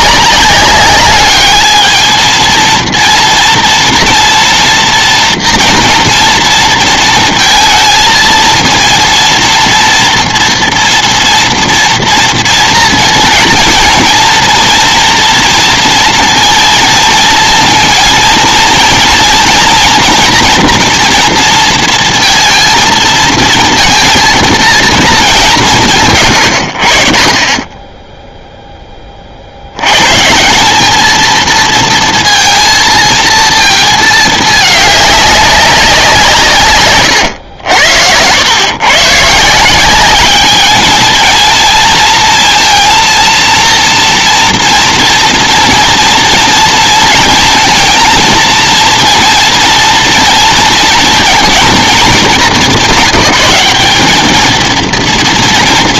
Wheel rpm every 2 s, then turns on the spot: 210, 230, 240, 230, 230, 230, 230, 230, 230, 230, 230, 230, 220, 40, 20, 210, 230, 200, 130, 120, 210, 230, 230, 230, 230, 230, 190, 220.
none